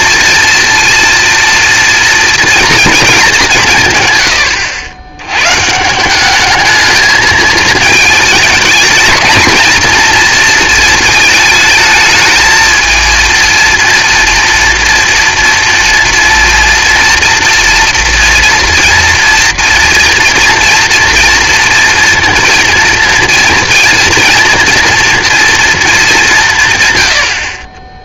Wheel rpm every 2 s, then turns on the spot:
230, 230, 100, 210, 220, 230, 220, 230, 230, 230, 230, 230, 230, 150.
none